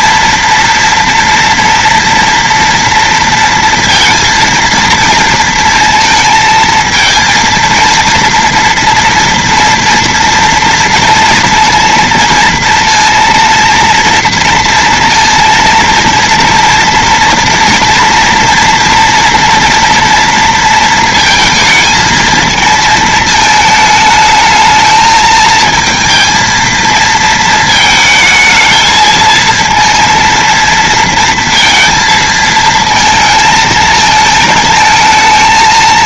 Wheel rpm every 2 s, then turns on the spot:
240, 230, 230, 230, 230, 230, 230, 230, 230, 230, 230, 220, 220, 230, 220, 230, 230, 220.
none